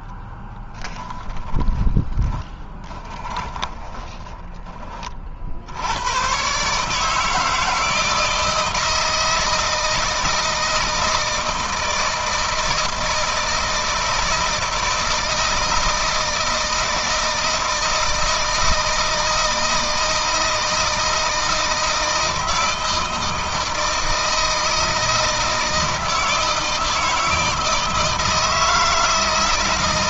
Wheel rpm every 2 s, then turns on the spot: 10, 20, 20, 140, 160, 160, 160, 170, 160, 160, 160, 160, 160, 160, 160.
0-4